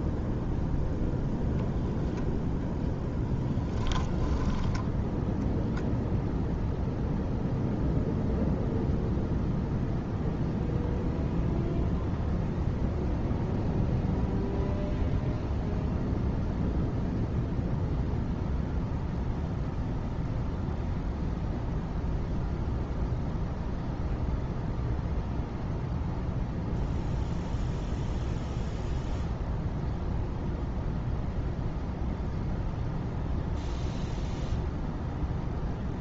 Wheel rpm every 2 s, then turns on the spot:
0, 0, 10, 0, 0, 0, 0, 0, 0, 0, 0, 0, 0, 0, 0, 0, 0, 0.
none